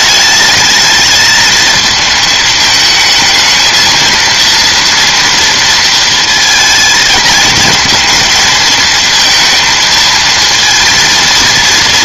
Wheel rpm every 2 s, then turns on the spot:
220, 220, 230, 230, 220, 230.
none